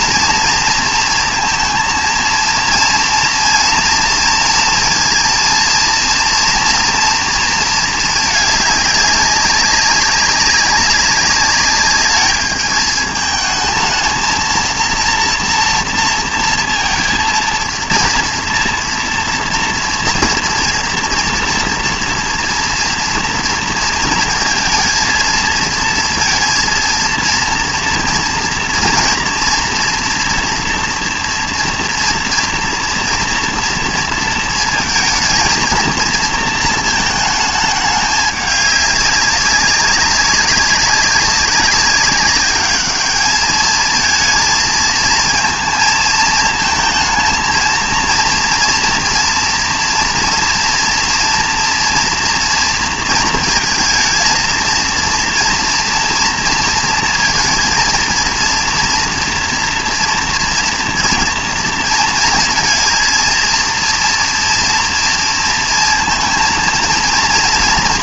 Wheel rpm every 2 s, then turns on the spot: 230, 230, 230, 230, 210, 200, 210, 230, 230, 230, 230, 230, 230, 230, 230, 230, 230, 230, 220, 200, 200, 210, 230, 220, 230, 230, 230, 230, 230, 230, 230, 230, 230, 230.
none